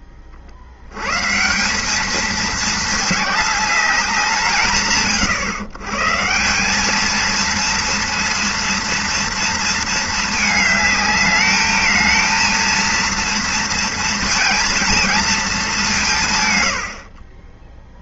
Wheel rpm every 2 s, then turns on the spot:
70, 220, 160, 180, 230, 220, 230, 230, 110.
none